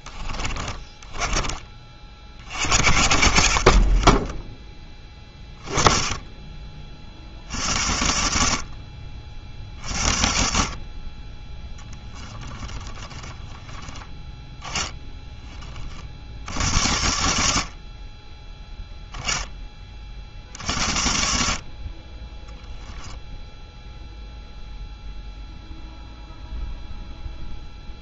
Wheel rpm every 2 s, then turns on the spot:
10, 60, 10, 30, 60, 40, 20, 10, 70, 10, 60, 10, 0, 0.
0-2 12-14 22-24